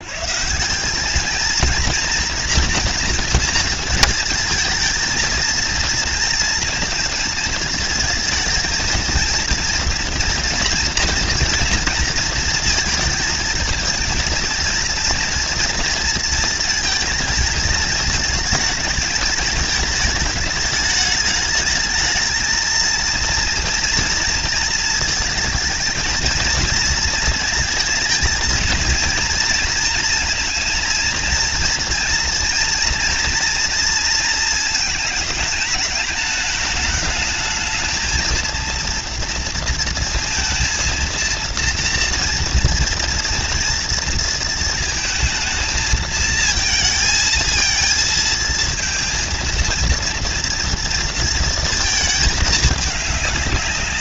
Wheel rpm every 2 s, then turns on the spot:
120, 230, 220, 230, 220, 230, 230, 230, 230, 220, 210, 220, 230, 220, 230, 230, 230, 230, 220, 220, 230, 230, 230, 220, 230, 230, 220.
none